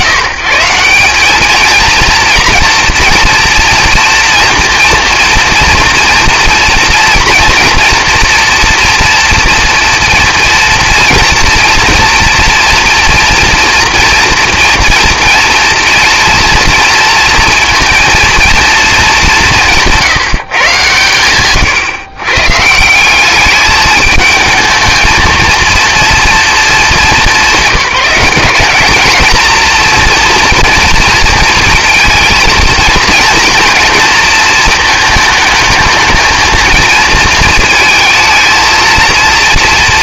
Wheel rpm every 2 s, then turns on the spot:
160, 240, 240, 240, 230, 230, 230, 230, 230, 210, 120, 180, 230, 200, 220, 230, 230, 220, 230, 230.
none